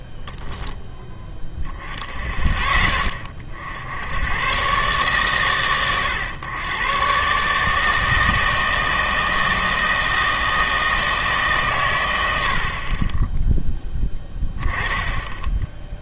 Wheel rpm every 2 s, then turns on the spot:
0, 10, 110, 110, 160, 160, 70, 10.
none